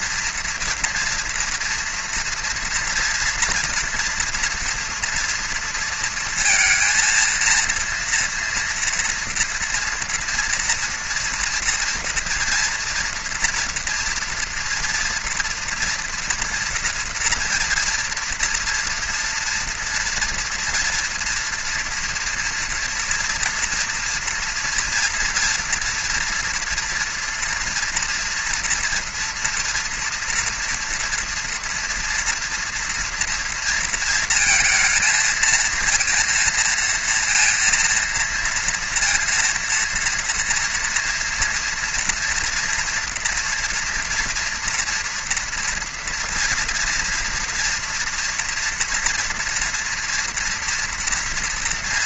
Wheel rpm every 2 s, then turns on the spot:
240, 230, 230, 230, 240, 240, 230, 240, 240, 240, 230, 230, 230, 240, 230, 230, 230, 230, 230, 230, 230, 230, 230, 230, 230, 230.
none